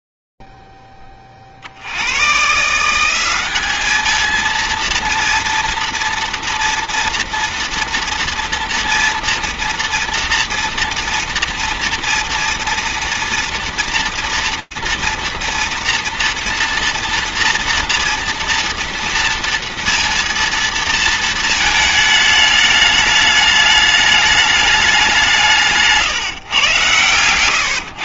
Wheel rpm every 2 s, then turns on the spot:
0, 120, 220, 230, 230, 230, 230, 230, 230, 230, 230, 210, 210, 120.
none